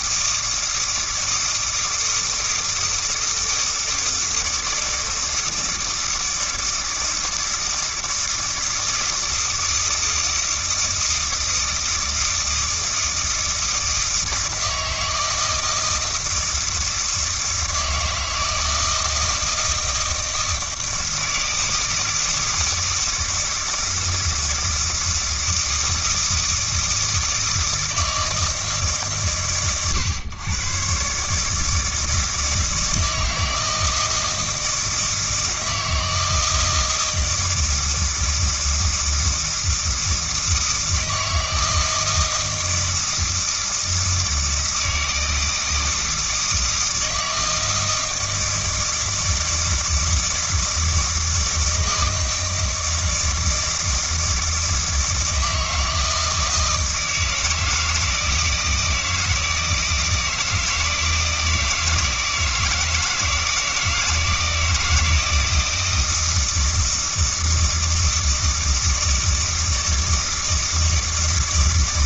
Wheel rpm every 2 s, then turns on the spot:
160, 160, 160, 160, 160, 160, 160, 160, 160, 160, 160, 160, 160, 160, 150, 120, 160, 160, 160, 160, 160, 160, 160, 160, 160, 160, 160, 160, 160, 160, 160, 160, 170, 160, 160, 160.
none